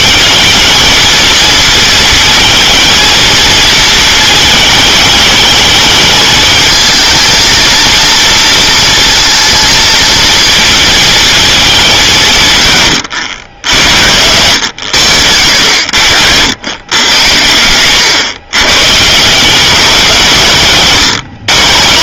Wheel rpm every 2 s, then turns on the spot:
210, 230, 210, 230, 230, 230, 120, 80, 90, 140, 160.
none